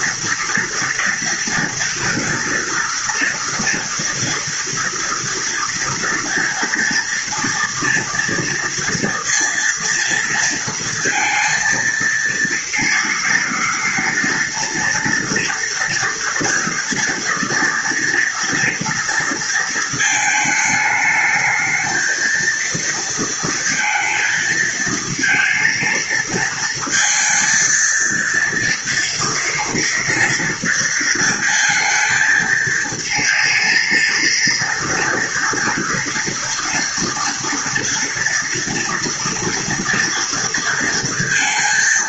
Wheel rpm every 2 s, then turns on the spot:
230, 230, 230, 230, 230, 230, 230, 230, 230, 230, 220, 230, 230, 230, 230, 230, 220, 230, 230, 230, 230.
none